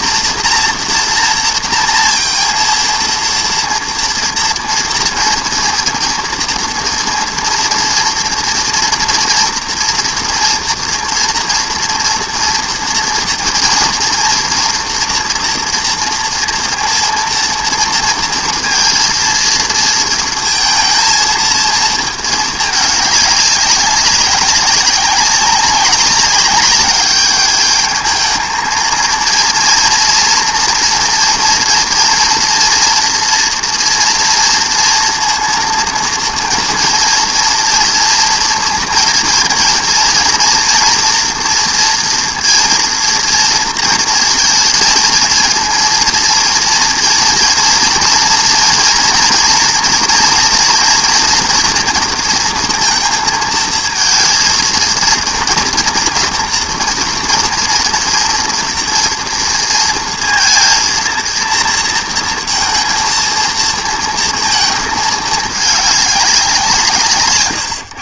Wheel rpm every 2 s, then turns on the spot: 230, 230, 230, 230, 230, 230, 230, 240, 230, 230, 220, 220, 200, 200, 220, 230, 230, 230, 230, 230, 230, 230, 220, 230, 230, 230, 230, 230, 230, 240, 230, 230, 230, 200.
none